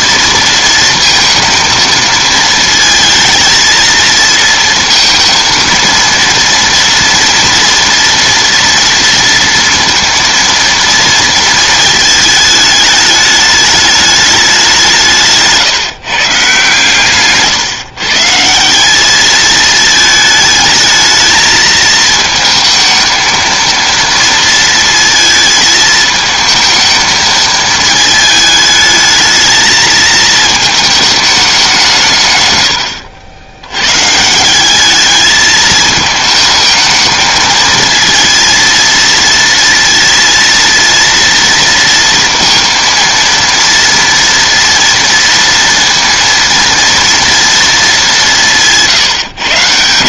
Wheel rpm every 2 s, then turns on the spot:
230, 230, 230, 230, 230, 230, 210, 190, 150, 180, 220, 220, 230, 220, 220, 220, 110, 180, 220, 230, 230, 230, 230, 230, 170.
none